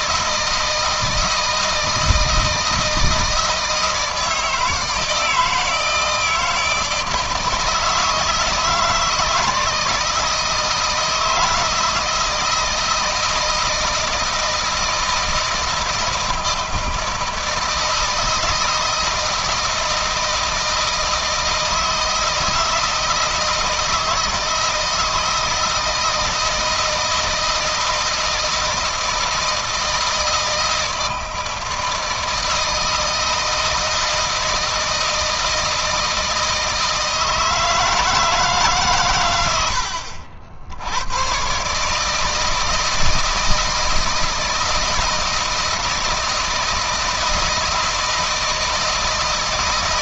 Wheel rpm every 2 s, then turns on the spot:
160, 160, 160, 160, 160, 160, 160, 160, 160, 160, 160, 160, 160, 160, 160, 160, 160, 160, 160, 120, 100, 160, 160, 160, 160.
none